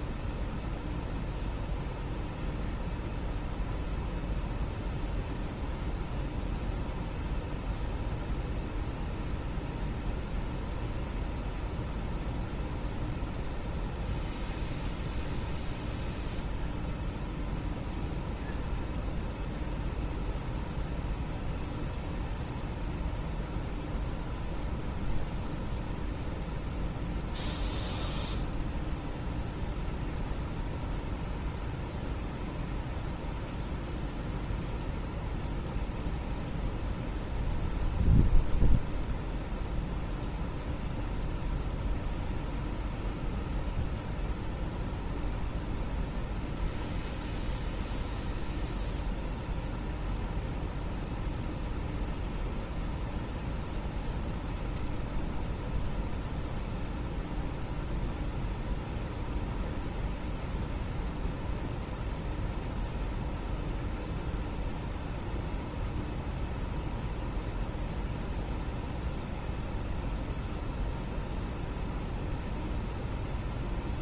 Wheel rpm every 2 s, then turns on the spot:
0, 0, 0, 0, 0, 0, 0, 0, 0, 0, 0, 0, 0, 0, 0, 0, 0, 0, 0, 0, 0, 0, 0, 0, 0, 0, 0, 0, 0, 0, 0, 0, 0, 0, 0, 0, 0.
none